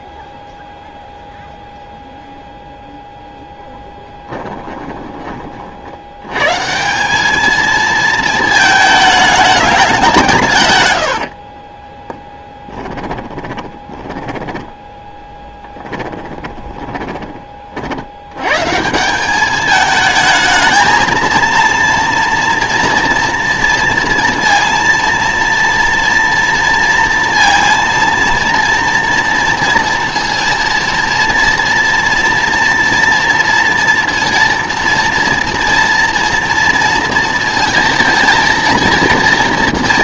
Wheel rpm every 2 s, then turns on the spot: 0, 0, 10, 140, 220, 120, 20, 10, 20, 140, 220, 230, 230, 230, 230, 230, 230, 230, 230, 230.
4-6 12-18